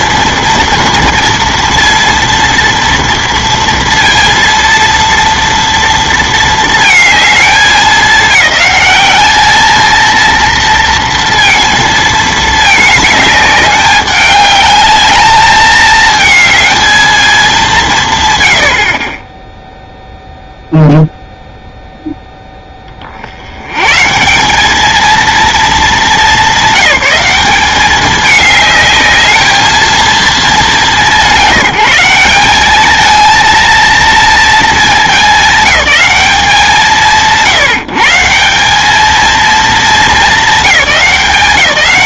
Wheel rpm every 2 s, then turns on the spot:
230, 230, 230, 220, 210, 230, 220, 210, 220, 60, 0, 20, 210, 190, 210, 200, 210, 210, 170, 190, 210.
none